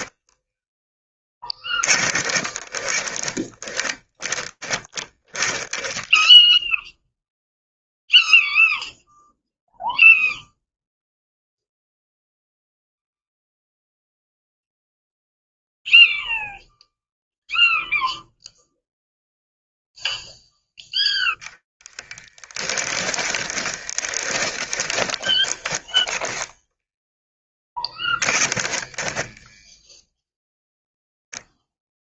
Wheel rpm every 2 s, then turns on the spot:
10, 10, 10, 0, 0, 0, 0, 0, 0, 0, 0, 20, 20, 0, 10, 0.
22-26